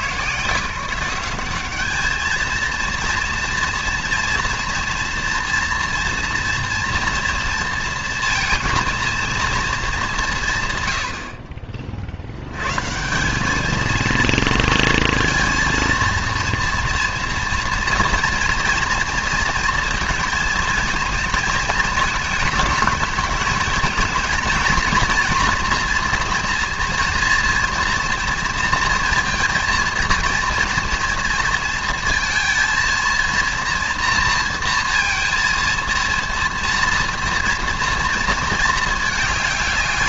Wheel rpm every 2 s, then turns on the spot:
160, 220, 230, 230, 230, 130, 110, 230, 230, 230, 230, 220, 230, 240, 230, 230, 230, 230, 230, 220.
none